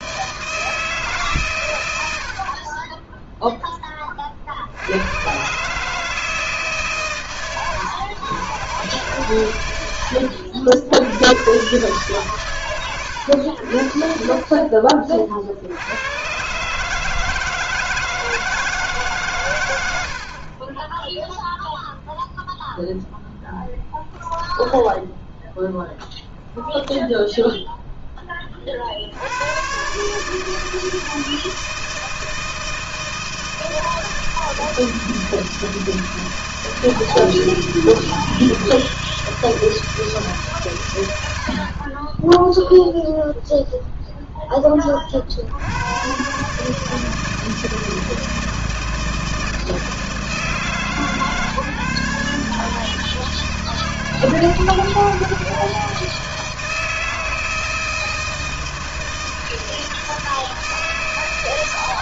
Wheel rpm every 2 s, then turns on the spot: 140, 10, 140, 130, 130, 120, 90, 60, 160, 110, 0, 0, 0, 0, 100, 160, 160, 160, 160, 160, 60, 0, 70, 160, 160, 150, 160, 160, 160, 160, 130.
none